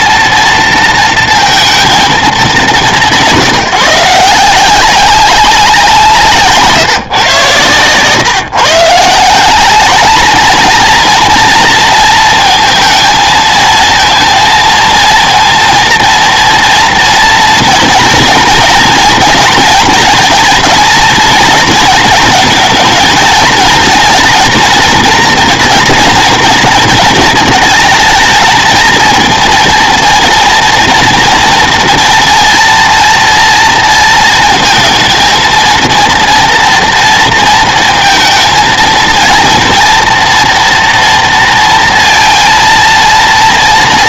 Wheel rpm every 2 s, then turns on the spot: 230, 200, 190, 150, 150, 230, 230, 230, 230, 230, 230, 230, 230, 230, 220, 230, 230, 230, 230, 230, 230, 230.
none